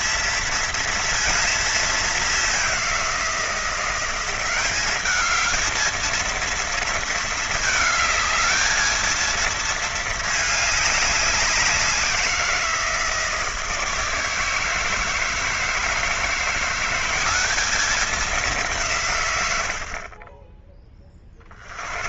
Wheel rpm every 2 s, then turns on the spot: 230, 190, 200, 230, 220, 200, 170, 160, 180, 170, 10.
none